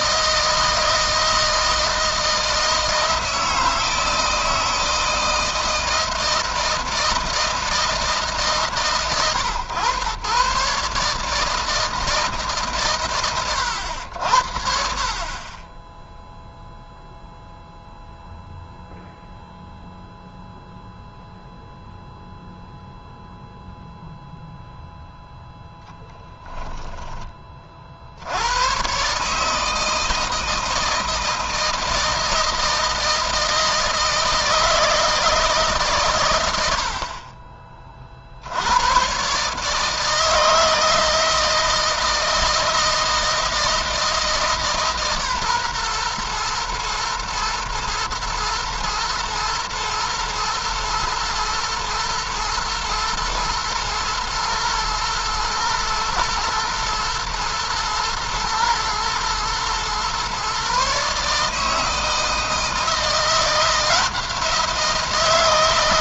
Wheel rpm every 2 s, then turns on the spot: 160, 160, 160, 160, 130, 150, 130, 50, 0, 0, 0, 0, 0, 10, 130, 160, 160, 160, 70, 110, 160, 160, 150, 120, 110, 110, 110, 110, 110, 110, 140, 170, 170.
none